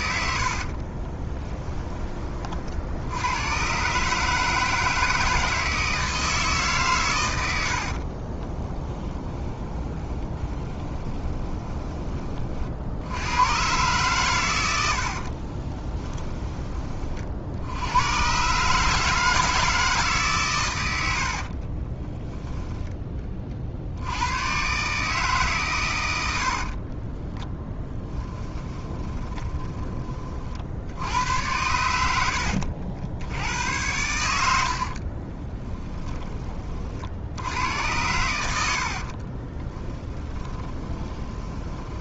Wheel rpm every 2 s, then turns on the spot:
40, 70, 160, 140, 20, 20, 60, 90, 30, 150, 110, 10, 130, 50, 20, 60, 70, 60, 30, 80, 20.
0-2 8-12 26-30 34-36 38-42